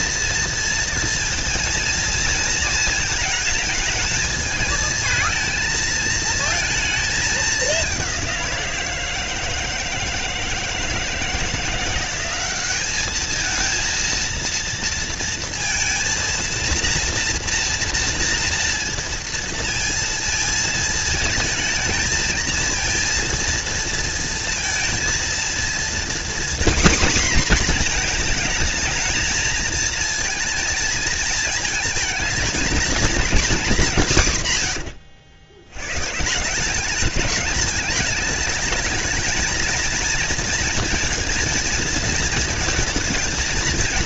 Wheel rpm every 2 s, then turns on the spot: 230, 230, 220, 220, 170, 160, 200, 230, 230, 230, 220, 230, 230, 250, 220, 220, 220, 90, 190, 220, 230, 230.
34-36